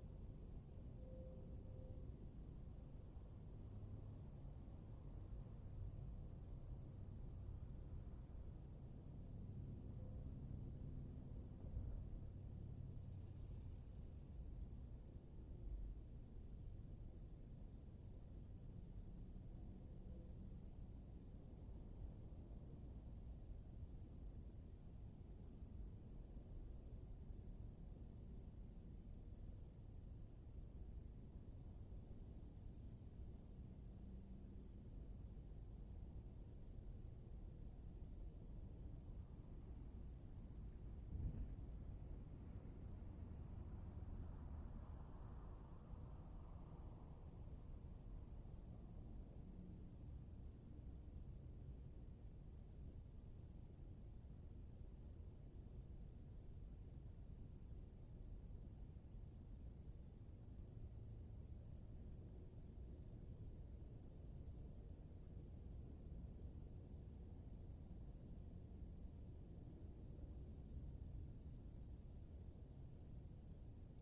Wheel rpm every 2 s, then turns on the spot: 0, 0, 0, 0, 0, 0, 0, 0, 0, 0, 0, 0, 0, 0, 0, 0, 0, 0, 0, 0, 0, 0, 0, 0, 0, 0, 0, 0, 0, 0, 0, 0, 0, 0, 0, 0, 0.
none